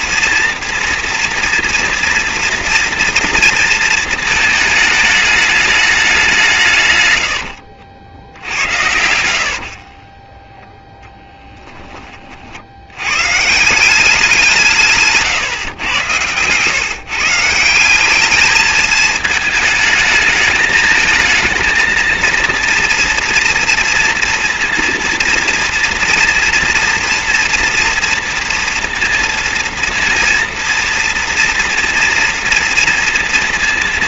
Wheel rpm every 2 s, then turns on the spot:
240, 240, 210, 120, 70, 10, 100, 150, 150, 220, 220, 230, 230, 240, 230, 230, 230.
8-10 14-16